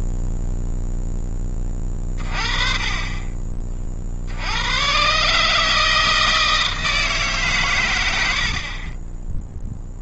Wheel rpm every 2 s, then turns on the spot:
0, 30, 70, 160, 80.
none